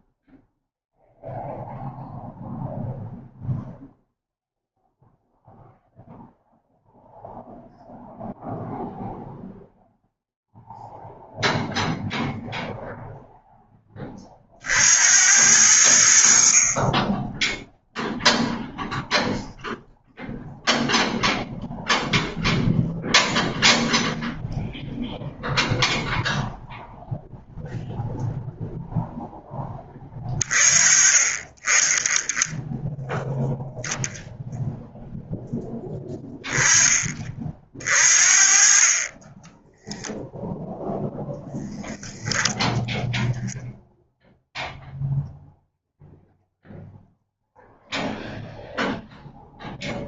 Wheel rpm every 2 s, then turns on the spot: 0, 0, 0, 0, 0, 0, 0, 70, 30, 0, 0, 0, 0, 0, 0, 30, 10, 0, 20, 30, 0, 0, 0, 0, 0.
none